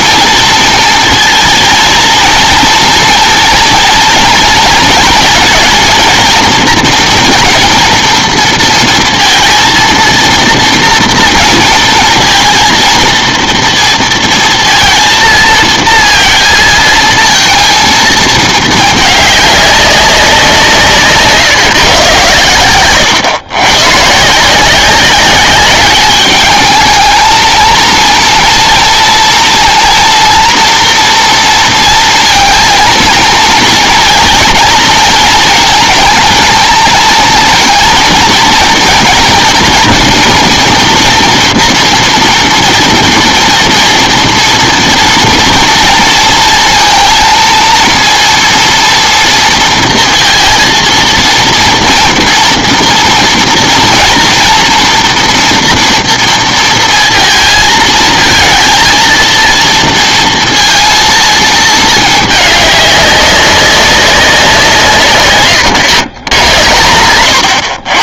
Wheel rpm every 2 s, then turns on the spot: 230, 230, 230, 230, 230, 230, 230, 230, 230, 220, 170, 110, 170, 210, 230, 230, 230, 230, 220, 230, 240, 230, 230, 230, 230, 230, 230, 240, 230, 230, 230, 210, 170, 110.
none